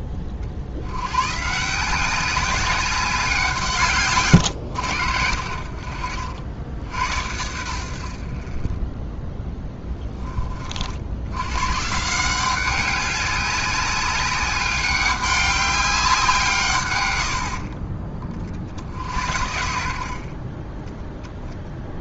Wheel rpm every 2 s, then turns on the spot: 50, 190, 100, 80, 20, 50, 190, 200, 120, 60, 20.
none